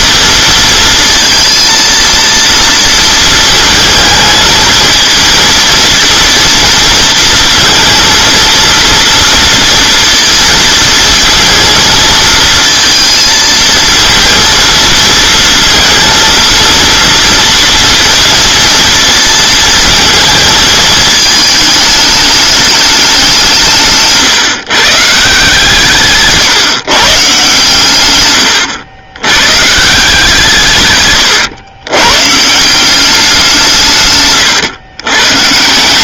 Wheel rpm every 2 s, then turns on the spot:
230, 230, 220, 230, 230, 230, 230, 230, 230, 230, 220, 200, 150, 150, 110, 140, 180, 110.
none